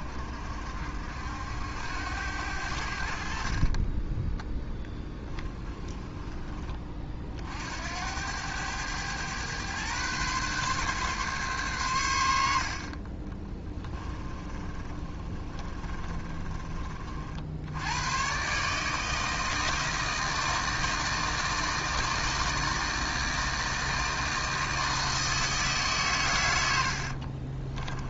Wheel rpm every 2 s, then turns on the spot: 60, 60, 10, 30, 110, 140, 40, 40, 50, 160, 160, 160, 160, 70.
4-6 14-16 26-28